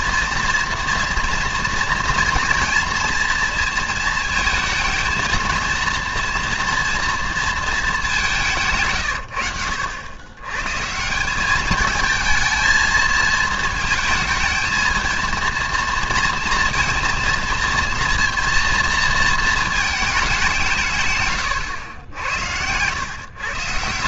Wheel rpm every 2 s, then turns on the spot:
230, 230, 220, 230, 140, 160, 220, 230, 230, 230, 140, 120.
none